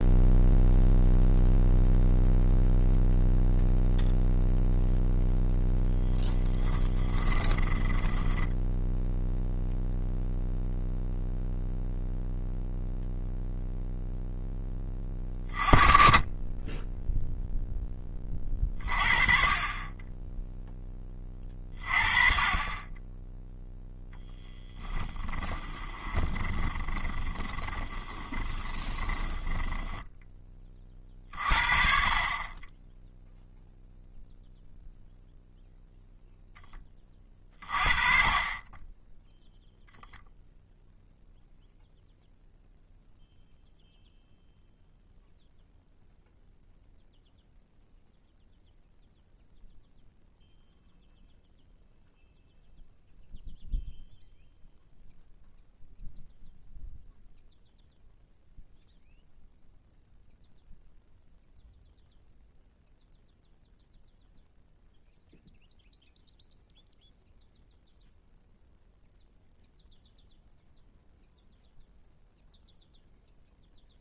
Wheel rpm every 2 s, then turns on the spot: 0, 0, 0, 20, 10, 0, 0, 10, 20, 30, 10, 30, 10, 20, 20, 20, 20, 0, 10, 20, 0, 0, 0, 0, 0, 0, 0, 0, 0, 0, 0, 0, 0, 0, 0, 0, 0.
6-10 26-30